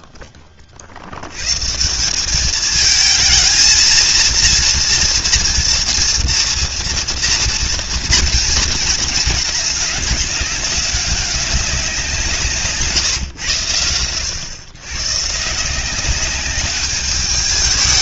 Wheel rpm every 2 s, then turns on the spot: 20, 210, 230, 230, 220, 190, 150, 110, 200.
none